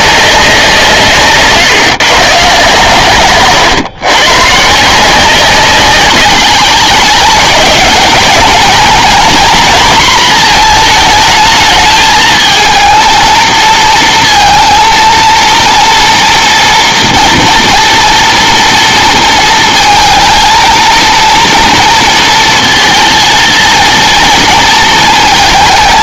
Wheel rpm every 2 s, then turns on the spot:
170, 140, 150, 200, 230, 230, 220, 230, 230, 230, 230, 230, 230.
none